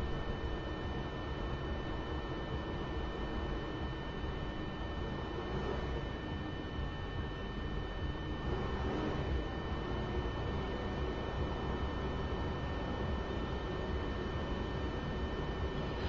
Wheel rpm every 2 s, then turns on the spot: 0, 0, 0, 0, 0, 0, 0, 0.
none